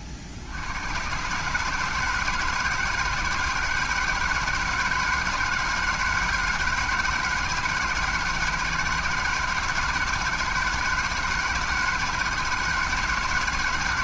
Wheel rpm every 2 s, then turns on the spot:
70, 160, 160, 170, 160, 160, 160.
none